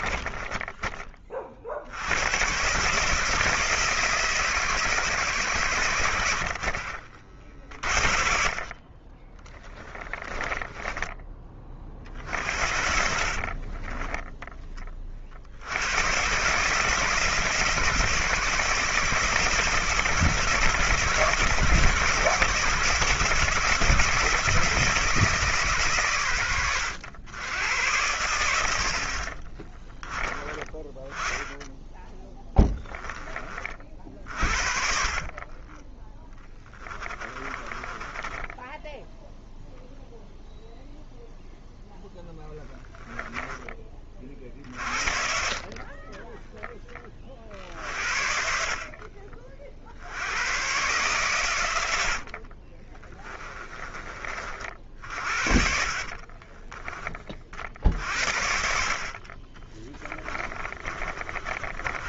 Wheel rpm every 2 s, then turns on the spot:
20, 140, 140, 60, 40, 20, 70, 20, 140, 150, 160, 160, 160, 100, 70, 10, 10, 60, 10, 10, 0, 0, 40, 20, 50, 110, 40, 50, 20, 50, 30.
0-2 6-8 10-14 26-28 32-34 36-40 44-46 52-54 56-58 60-62